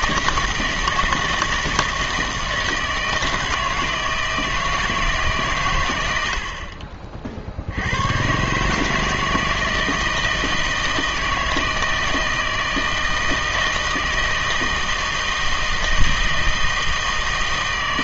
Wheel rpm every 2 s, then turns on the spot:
160, 160, 160, 40, 150, 160, 160, 160, 160.
none